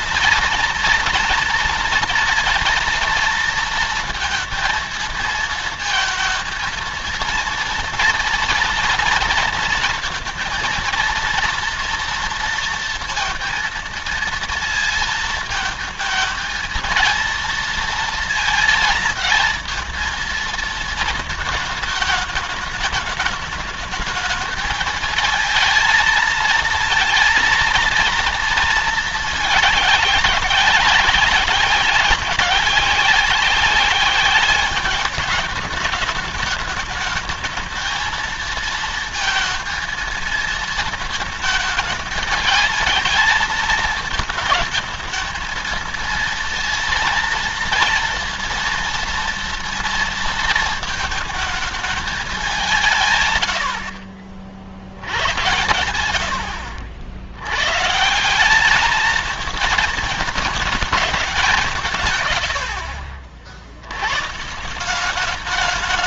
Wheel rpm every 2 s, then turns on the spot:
230, 230, 230, 230, 230, 230, 230, 230, 220, 230, 220, 210, 210, 230, 230, 190, 190, 200, 220, 230, 230, 220, 220, 230, 230, 230, 190, 70, 80, 190, 220, 90, 150.
none